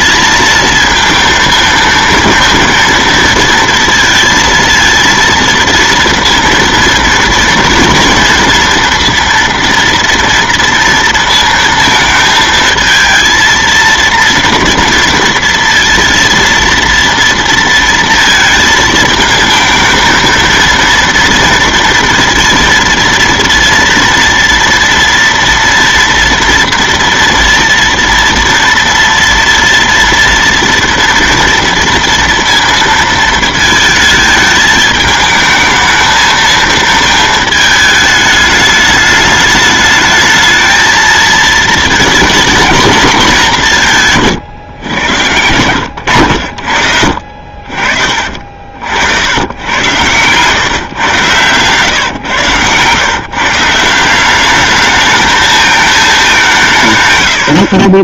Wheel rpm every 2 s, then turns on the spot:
220, 230, 230, 230, 230, 230, 230, 230, 230, 230, 230, 230, 230, 230, 230, 230, 230, 220, 230, 210, 220, 220, 120, 70, 40, 130, 120, 200, 160.
none